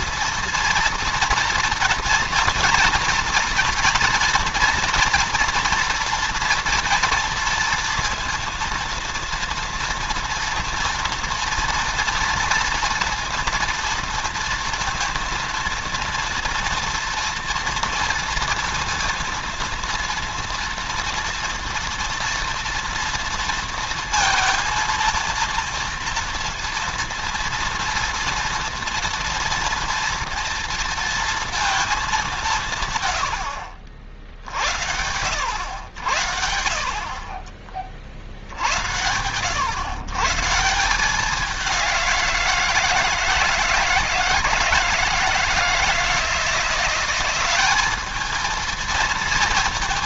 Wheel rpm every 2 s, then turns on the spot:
230, 230, 240, 230, 230, 230, 230, 230, 230, 230, 230, 230, 230, 230, 230, 230, 140, 80, 60, 80, 180, 170, 160, 180, 220.
none